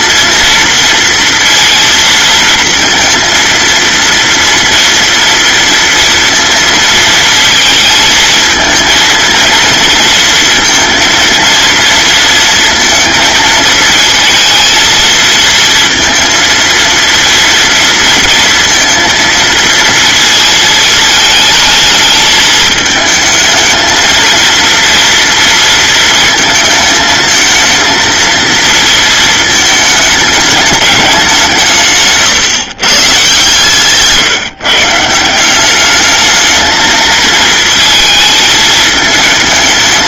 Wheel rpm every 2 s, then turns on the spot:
230, 230, 230, 230, 230, 230, 230, 230, 230, 230, 220, 220, 230, 220, 230, 210, 140, 150, 220, 220.
none